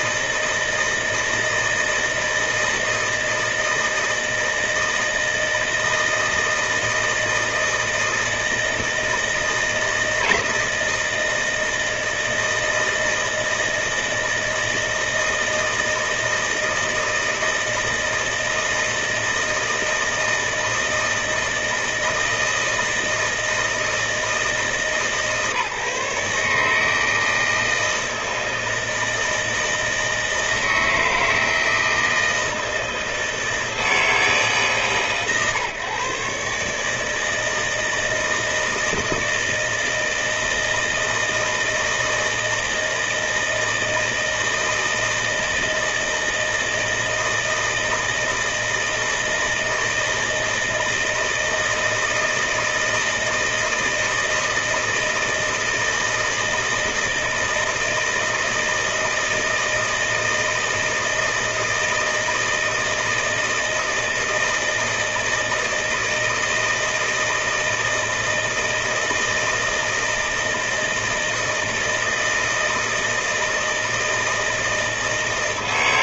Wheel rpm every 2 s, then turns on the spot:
160, 160, 160, 160, 160, 160, 160, 160, 160, 160, 160, 160, 150, 140, 160, 160, 160, 150, 140, 160, 160, 160, 160, 160, 160, 160, 160, 160, 160, 160, 160, 160, 160, 160, 160, 160, 160, 160.
none